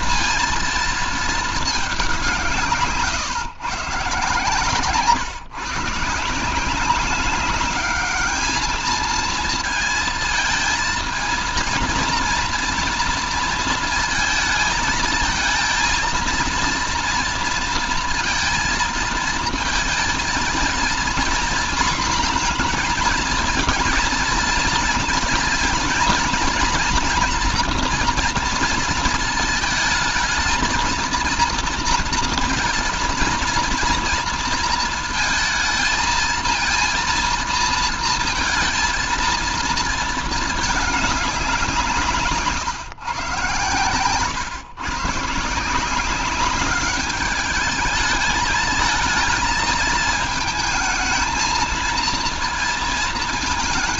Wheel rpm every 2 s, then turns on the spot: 230, 160, 140, 180, 220, 220, 230, 220, 230, 230, 230, 230, 230, 230, 230, 220, 230, 230, 230, 230, 210, 130, 140, 200, 220, 220, 230.
none